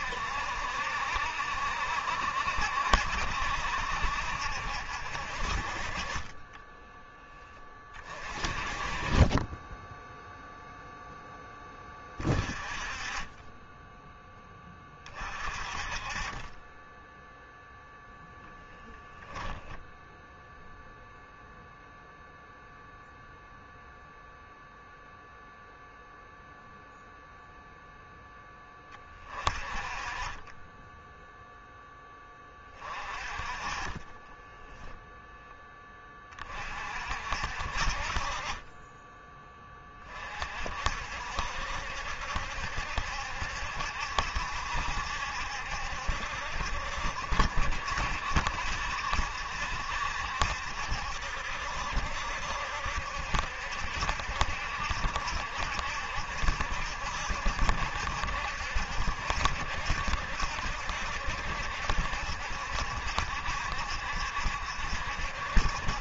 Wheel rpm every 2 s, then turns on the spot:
70, 70, 60, 10, 30, 0, 20, 30, 10, 0, 0, 0, 0, 0, 20, 10, 30, 10, 50, 20, 50, 70, 70, 70, 70, 70, 70, 70, 70, 70, 70, 70, 60.
34-36 38-40